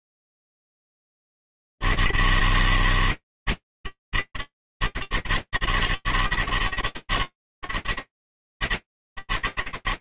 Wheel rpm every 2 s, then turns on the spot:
160, 160, 160, 160, 130.
none